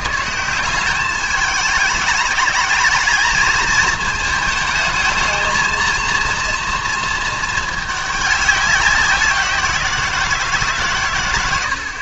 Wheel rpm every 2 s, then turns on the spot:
170, 210, 220, 230, 200, 150.
none